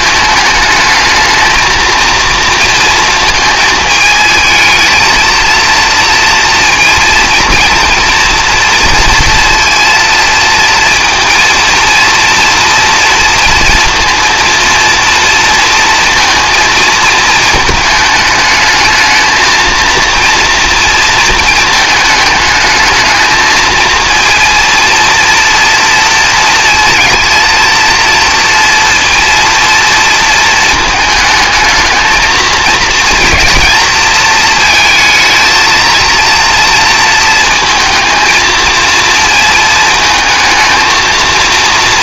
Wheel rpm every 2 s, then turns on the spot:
220, 230, 220, 230, 230, 230, 230, 230, 230, 210, 230, 220, 230, 230, 230, 230, 220, 220, 230, 220, 220.
none